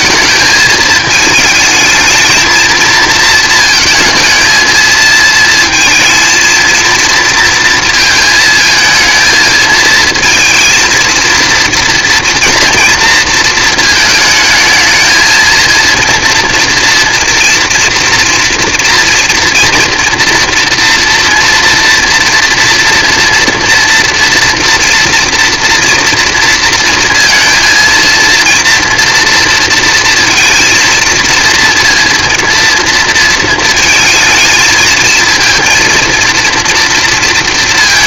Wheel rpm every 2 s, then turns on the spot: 220, 230, 220, 230, 220, 230, 230, 220, 230, 240, 230, 230, 230, 230, 230, 230, 230, 220, 230.
none